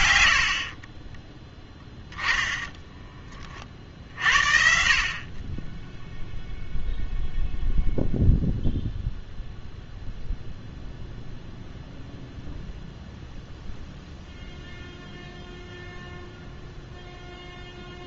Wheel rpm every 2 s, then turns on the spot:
90, 10, 50, 0, 0, 0, 0, 0, 0.
none